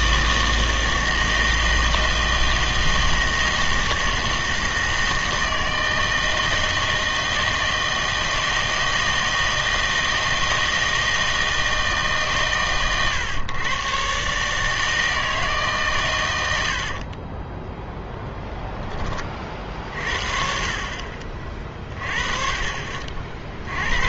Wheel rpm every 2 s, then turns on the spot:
160, 160, 160, 160, 160, 160, 130, 150, 90, 20, 50, 40.
18-20